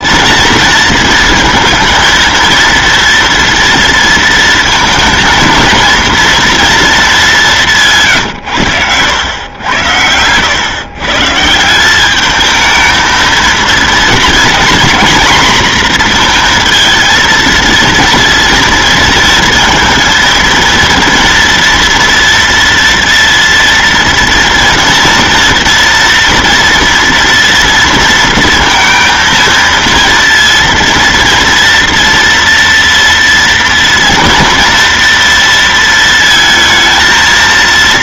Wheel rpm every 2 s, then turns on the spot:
230, 230, 230, 230, 100, 140, 230, 240, 230, 230, 240, 230, 230, 240, 230, 230, 230, 230, 230.
none